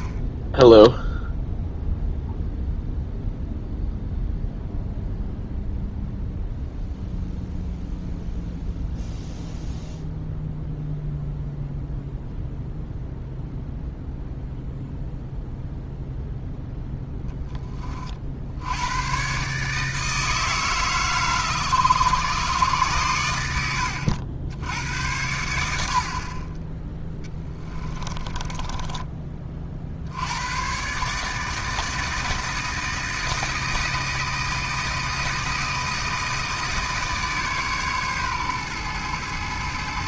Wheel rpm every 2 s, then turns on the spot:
0, 0, 0, 0, 0, 0, 0, 0, 10, 90, 150, 120, 90, 10, 20, 110, 160, 160, 160, 120.
28-30